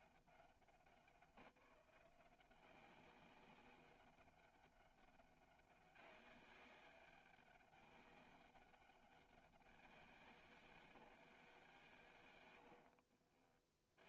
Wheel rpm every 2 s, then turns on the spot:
190, 180, 190, 200, 200, 170, 90.
12-14